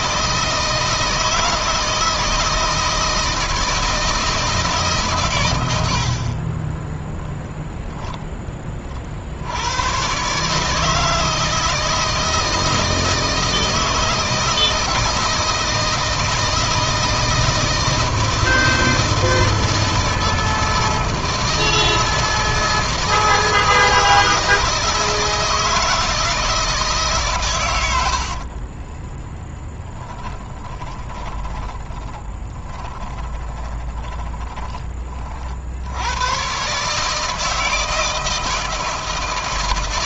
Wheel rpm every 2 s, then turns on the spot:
160, 160, 130, 10, 50, 160, 160, 160, 160, 160, 160, 160, 160, 150, 20, 20, 20, 30, 150, 160.
28-34